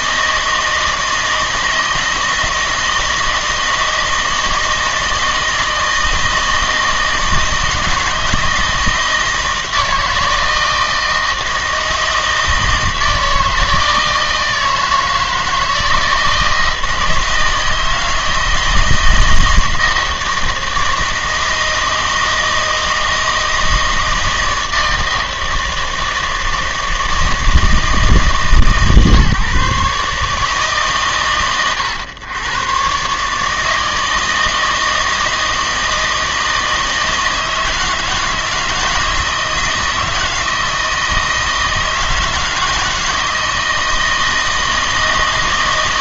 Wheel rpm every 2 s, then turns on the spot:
160, 160, 160, 160, 160, 160, 160, 160, 160, 160, 160, 160, 160, 160, 150, 150, 120, 160, 160, 160, 160, 160, 160.
none